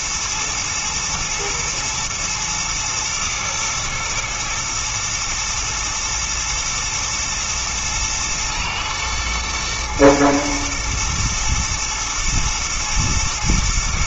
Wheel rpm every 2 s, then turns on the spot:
120, 120, 110, 110, 110, 110, 110.
none